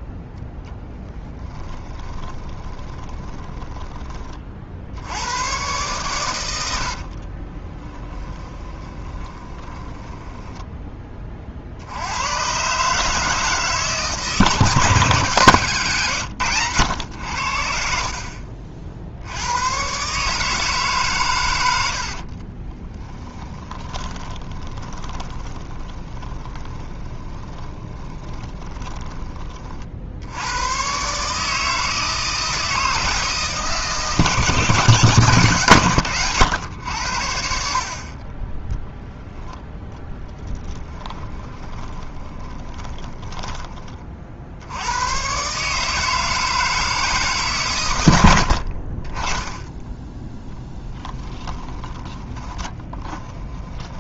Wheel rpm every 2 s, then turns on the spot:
10, 20, 50, 80, 20, 10, 140, 150, 110, 50, 150, 20, 20, 20, 10, 110, 160, 150, 100, 10, 10, 20, 80, 160, 60, 0, 10.
2-4 8-10 22-30 40-44 48-50 52-54